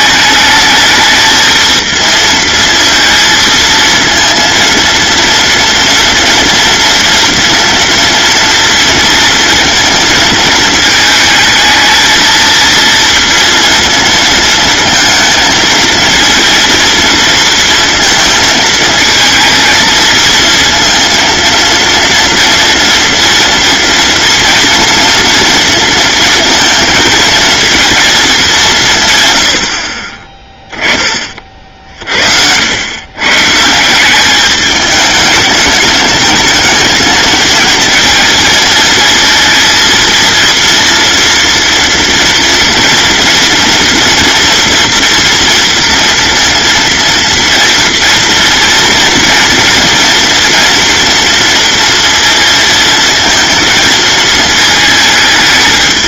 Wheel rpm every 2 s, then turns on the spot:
220, 230, 230, 240, 230, 220, 230, 230, 230, 230, 230, 240, 230, 230, 180, 10, 90, 210, 220, 230, 230, 230, 230, 230, 230, 230, 230, 220.
none